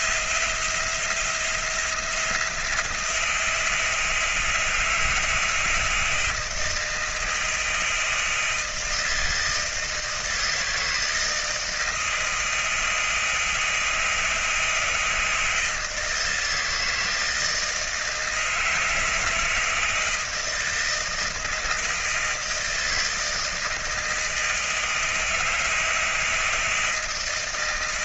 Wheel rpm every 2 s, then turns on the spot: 170, 170, 160, 160, 160, 160, 160, 160, 160, 160, 160, 160, 160, 160.
none